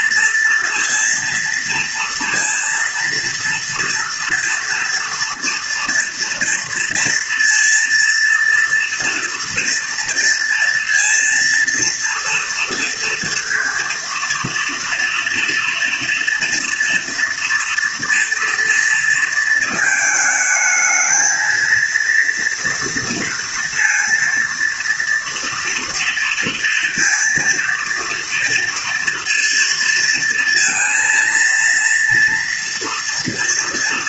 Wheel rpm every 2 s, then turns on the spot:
230, 230, 230, 230, 230, 230, 230, 230, 230, 230, 220, 240, 230, 230, 230, 230, 230.
none